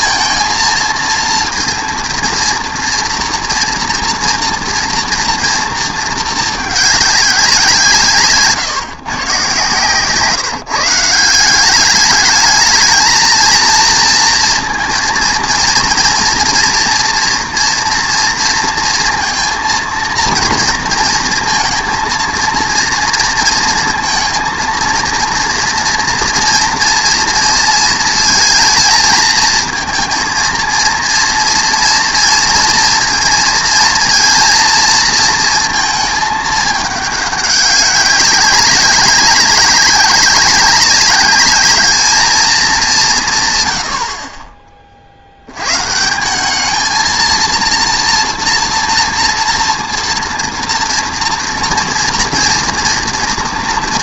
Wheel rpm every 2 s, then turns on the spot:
230, 230, 230, 210, 160, 160, 220, 230, 240, 230, 230, 230, 230, 240, 230, 230, 230, 230, 210, 190, 190, 210, 30, 210, 230, 230, 240.
none